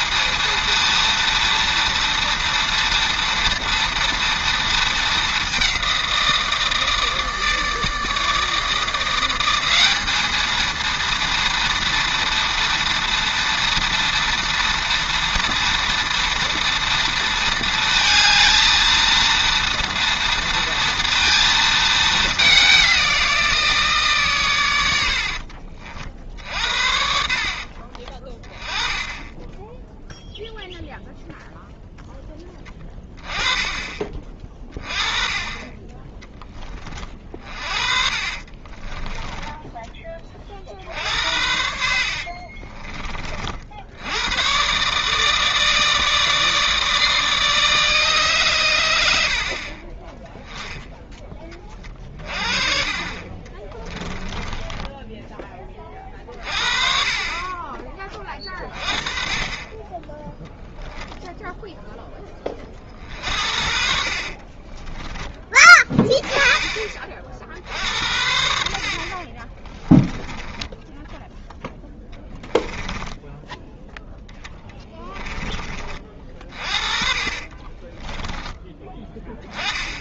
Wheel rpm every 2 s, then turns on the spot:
230, 230, 230, 160, 160, 220, 230, 230, 230, 220, 230, 200, 110, 60, 20, 0, 20, 30, 20, 40, 50, 30, 130, 160, 110, 10, 40, 20, 40, 30, 10, 30, 30, 30, 70, 10, 10, 20, 30, 10.
38-40 42-44 54-56 64-66 72-78